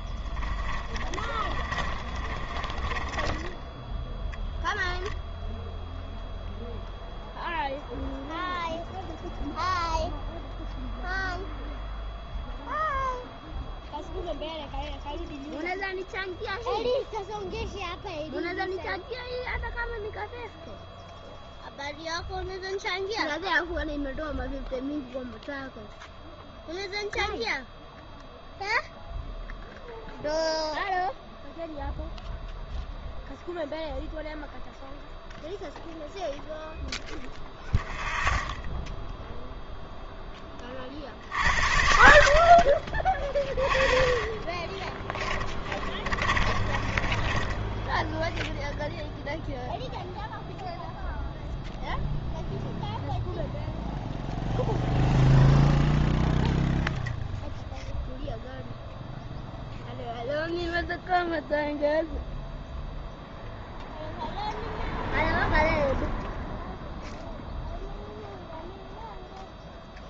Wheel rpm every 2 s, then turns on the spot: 30, 30, 0, 0, 0, 0, 0, 0, 0, 0, 0, 0, 0, 0, 0, 0, 0, 0, 0, 0, 30, 50, 20, 30, 0, 0, 0, 0, 10, 0, 0, 0, 0, 0, 0.
0-4 44-48